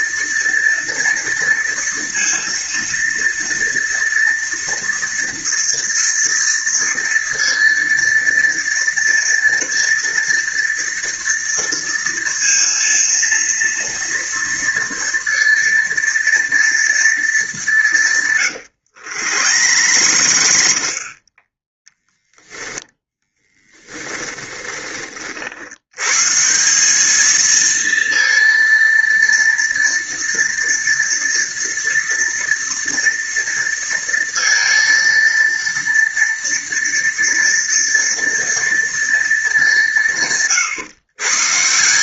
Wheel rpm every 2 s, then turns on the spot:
230, 230, 230, 230, 230, 230, 230, 230, 230, 120, 70, 10, 20, 180, 230, 230, 240, 230, 230, 230, 130.
18-24